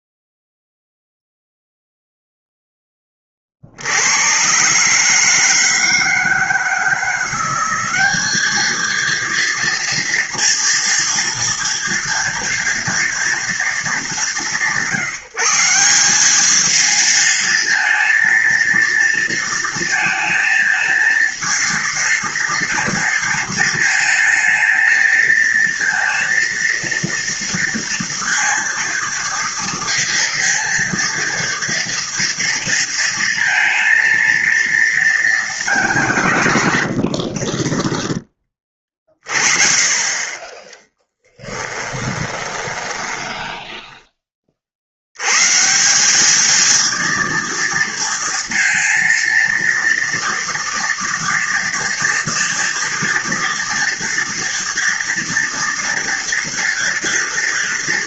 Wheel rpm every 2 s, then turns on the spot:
0, 0, 120, 160, 220, 230, 230, 150, 210, 230, 220, 230, 220, 230, 230, 230, 230, 230, 130, 20, 20, 20, 40, 220, 230, 240, 230, 230, 230.
42-44